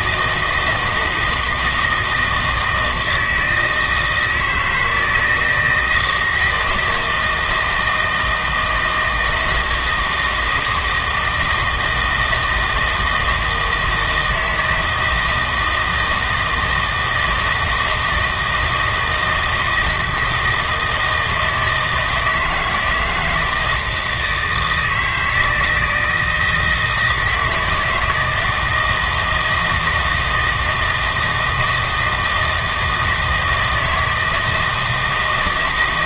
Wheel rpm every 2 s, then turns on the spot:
160, 160, 160, 160, 170, 160, 160, 160, 160, 160, 160, 160, 160, 160, 160, 160, 160, 160.
none